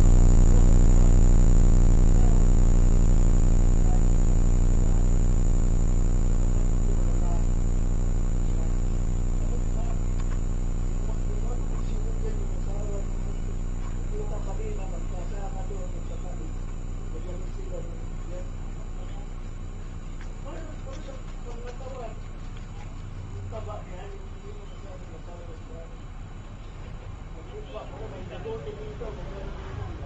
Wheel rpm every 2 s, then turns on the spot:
0, 0, 0, 0, 0, 0, 0, 0, 0, 0, 0, 0, 0, 0, 0.
none